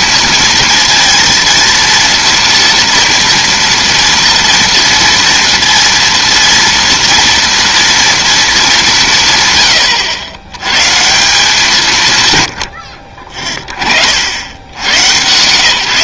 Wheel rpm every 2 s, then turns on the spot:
230, 230, 230, 230, 190, 140, 70, 100.
none